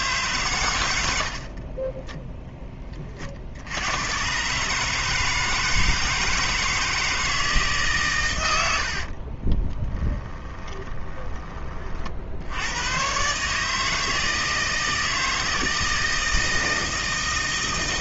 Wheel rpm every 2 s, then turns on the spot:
120, 20, 140, 160, 90, 20, 80, 160, 160.
10-12